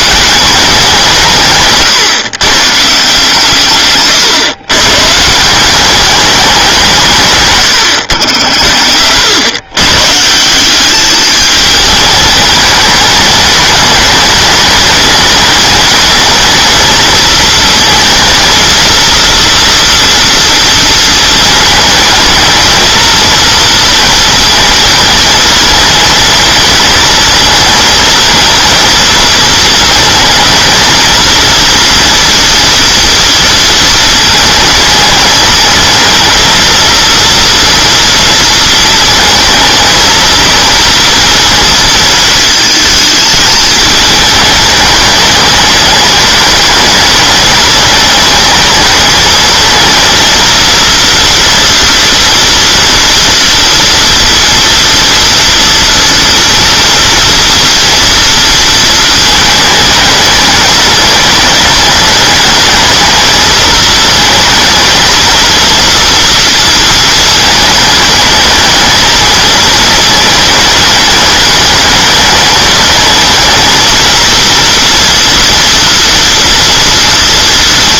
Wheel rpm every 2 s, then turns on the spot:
180, 150, 130, 190, 80, 190, 210, 210, 220, 230, 230, 220, 220, 220, 220, 220, 230, 220, 230, 230, 230, 220, 210, 220, 210, 230, 230, 230, 230, 230, 220, 220, 220, 230, 220, 210, 210, 240, 230.
none